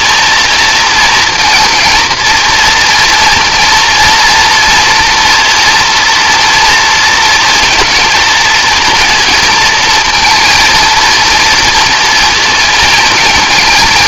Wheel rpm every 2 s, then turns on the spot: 230, 230, 240, 230, 230, 230, 220.
none